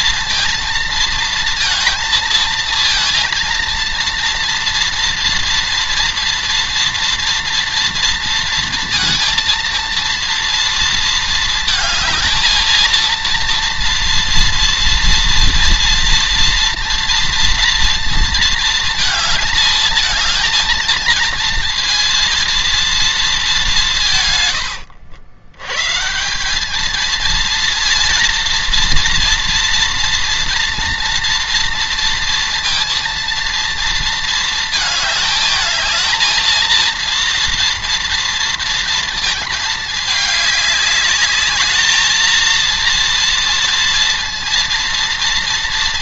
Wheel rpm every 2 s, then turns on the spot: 230, 230, 230, 230, 230, 230, 230, 230, 230, 230, 230, 230, 110, 190, 230, 230, 230, 220, 220, 230, 210, 230, 230.
24-26